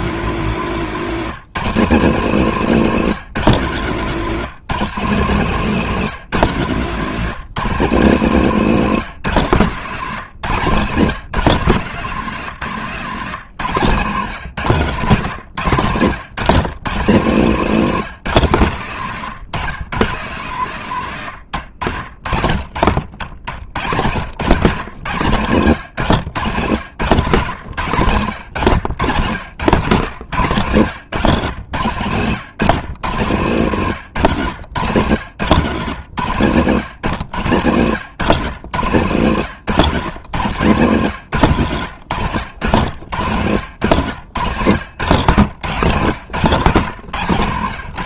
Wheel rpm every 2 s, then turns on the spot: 180, 170, 170, 150, 170, 150, 160, 150, 150, 140, 130, 60, 130, 130, 120, 130, 140, 130, 120, 120, 120, 90, 110, 140.
6-8 26-30 34-38 40-46